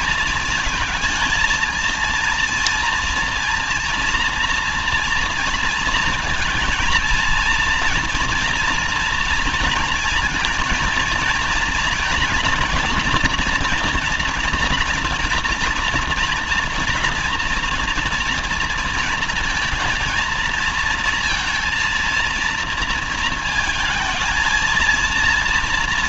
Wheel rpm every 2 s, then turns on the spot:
220, 230, 240, 230, 230, 230, 230, 230, 240, 230, 230, 230, 230.
none